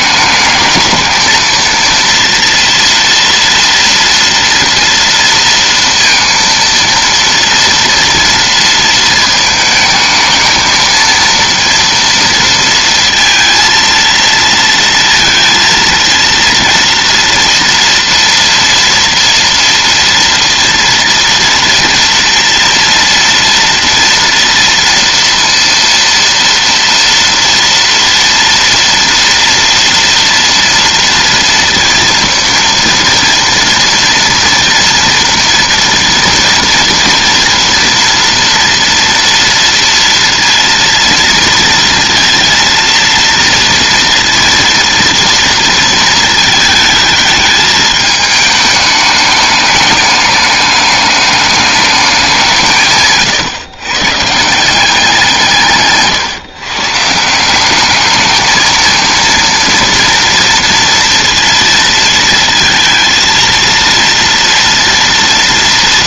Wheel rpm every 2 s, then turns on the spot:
220, 230, 230, 230, 230, 220, 230, 230, 230, 230, 230, 230, 230, 230, 230, 230, 230, 230, 230, 230, 230, 230, 230, 220, 210, 210, 160, 180, 150, 220, 230, 230, 230.
none